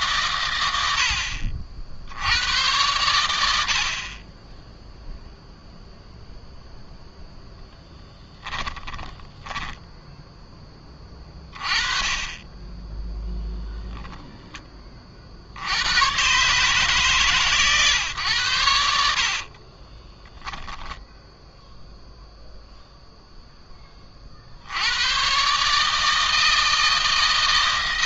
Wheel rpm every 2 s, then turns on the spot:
100, 100, 10, 0, 30, 20, 10, 20, 140, 80, 10, 0, 80, 160.
8-10 18-22